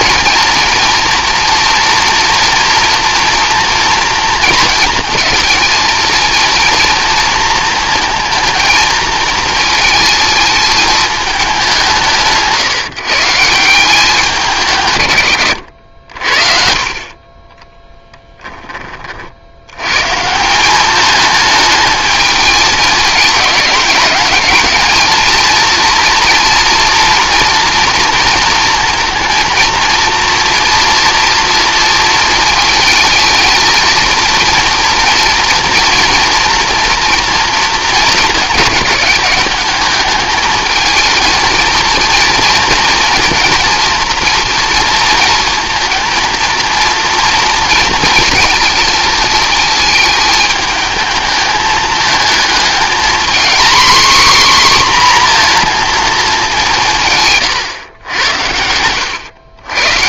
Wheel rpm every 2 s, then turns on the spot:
240, 240, 230, 230, 220, 220, 160, 160, 40, 20, 200, 220, 220, 240, 220, 230, 230, 230, 230, 210, 220, 230, 230, 230, 230, 210, 220, 260, 170, 90.
58-60